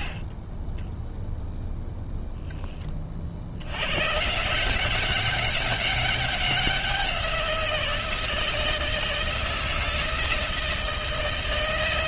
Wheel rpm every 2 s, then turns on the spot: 30, 20, 180, 190, 160, 160.
none